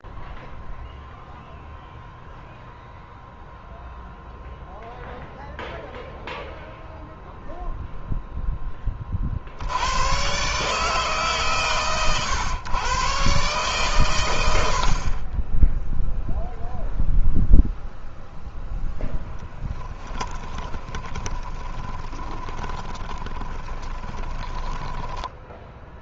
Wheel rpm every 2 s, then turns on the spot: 0, 0, 0, 0, 10, 140, 120, 80, 0, 0, 20, 20, 20.
20-26